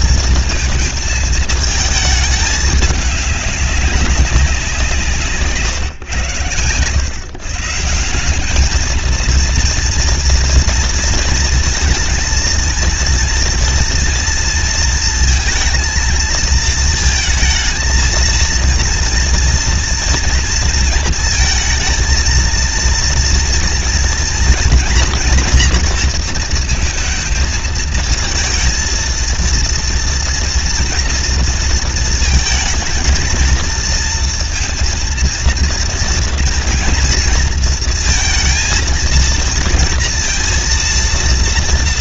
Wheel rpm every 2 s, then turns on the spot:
230, 220, 190, 120, 200, 230, 230, 230, 230, 230, 230, 230, 230, 230, 220, 230, 230, 230, 230, 230, 230.
none